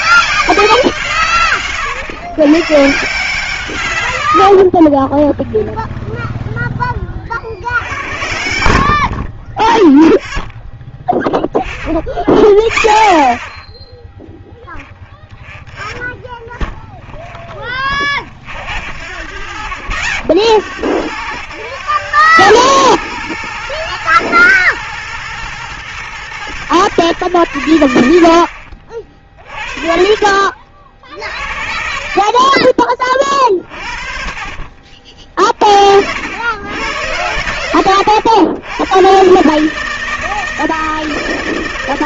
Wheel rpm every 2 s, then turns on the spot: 180, 130, 50, 20, 70, 0, 0, 0, 10, 50, 70, 110, 120, 120, 50, 40, 30, 40, 100, 100, 160.
4-8 16-18 28-30